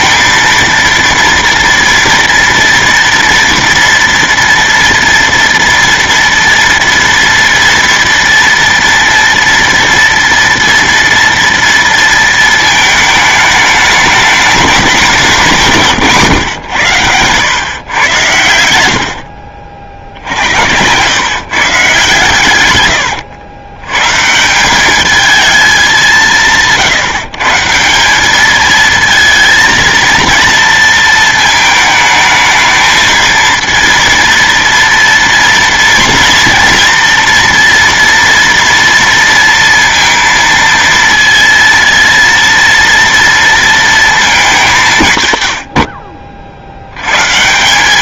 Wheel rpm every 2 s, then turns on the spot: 230, 230, 230, 230, 230, 230, 220, 210, 110, 80, 90, 110, 190, 170, 220, 230, 220, 230, 230, 230, 230, 230, 190, 70.
none